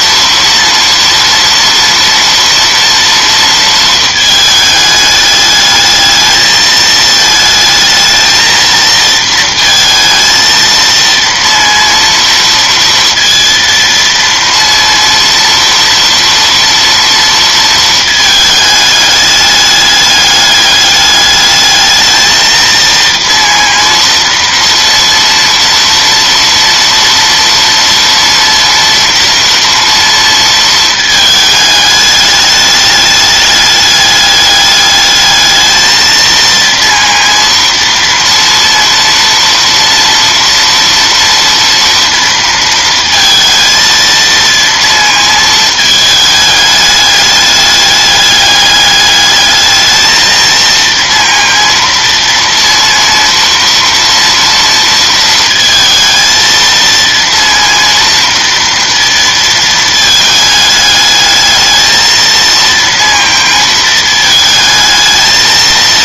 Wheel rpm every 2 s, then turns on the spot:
230, 230, 210, 220, 230, 230, 230, 230, 230, 210, 210, 230, 230, 230, 230, 220, 210, 210, 230, 230, 230, 230, 230, 210, 210, 230, 230, 230, 230, 230, 210, 230, 220.
none